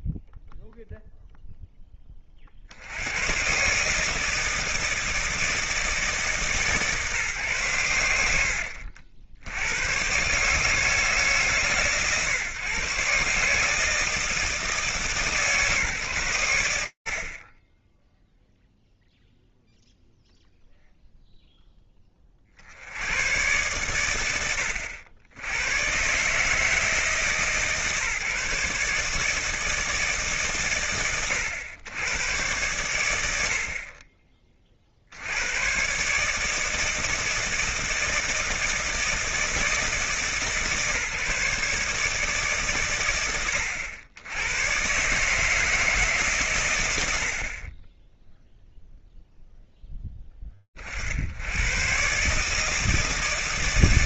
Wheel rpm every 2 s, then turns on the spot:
0, 120, 160, 120, 70, 150, 150, 150, 30, 0, 0, 110, 80, 150, 150, 90, 90, 110, 160, 160, 150, 110, 140, 90, 0, 70, 160.
none